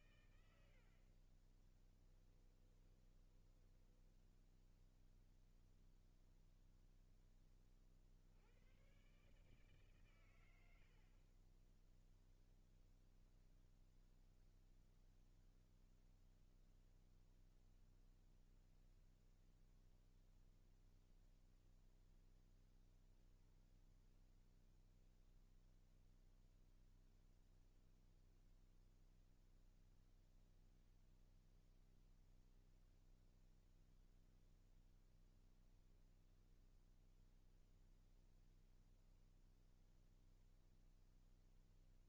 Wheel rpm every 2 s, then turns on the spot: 120, 10, 10, 0, 90, 120, 10, 0, 0, 0, 0, 0, 0, 0, 0, 0, 0, 0, 0, 0, 0.
0-6